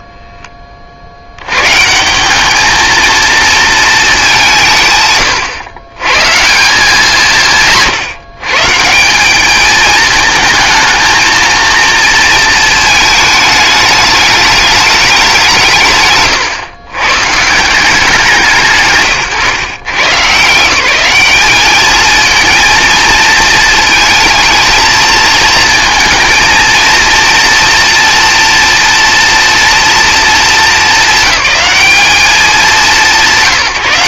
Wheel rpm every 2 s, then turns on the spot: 20, 210, 170, 170, 160, 220, 220, 210, 130, 150, 170, 230, 220, 220, 230, 210, 180.
none